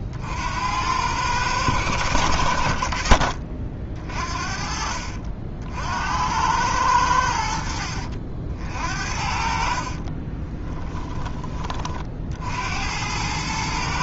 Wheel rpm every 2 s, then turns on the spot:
70, 70, 50, 100, 60, 30, 70.
4-6 10-12